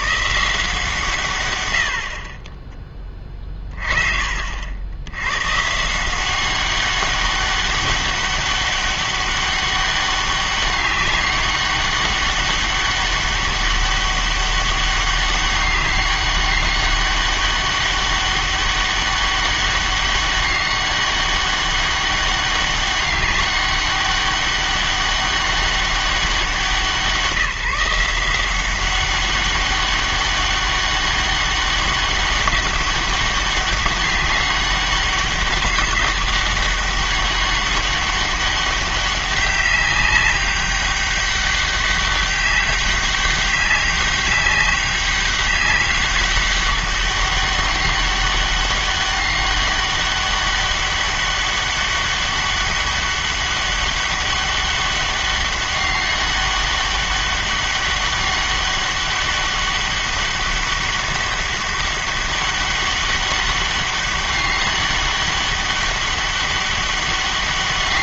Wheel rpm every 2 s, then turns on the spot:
170, 20, 70, 190, 200, 200, 200, 200, 200, 200, 200, 200, 200, 180, 180, 200, 200, 200, 200, 200, 200, 200, 200, 200, 200, 200, 200, 200, 200, 200, 200, 200, 200, 200.
none